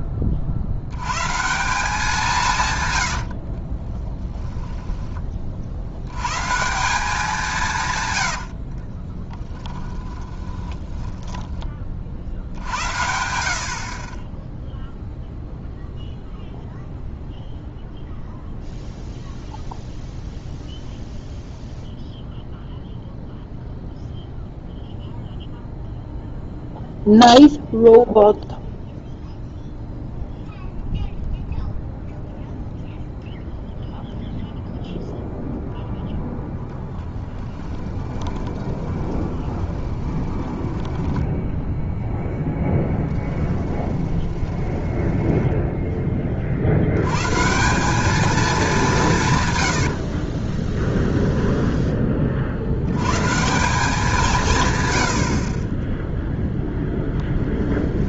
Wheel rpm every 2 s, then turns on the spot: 50, 130, 10, 160, 60, 20, 70, 0, 0, 0, 0, 0, 0, 0, 0, 0, 0, 0, 0, 20, 10, 10, 10, 70, 200, 10, 60, 130, 0.
8-12 38-46 50-52